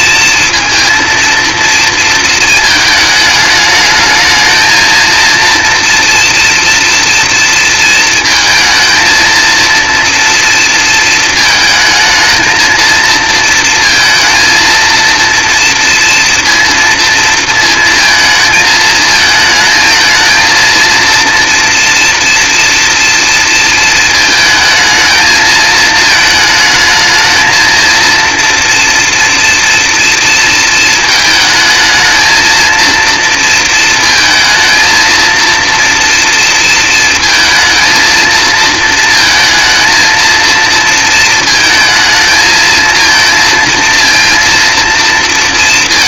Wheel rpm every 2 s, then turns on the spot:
230, 220, 220, 240, 230, 230, 220, 230, 230, 220, 230, 230, 220, 220, 230, 220, 220, 220, 230, 230, 230, 220, 230.
none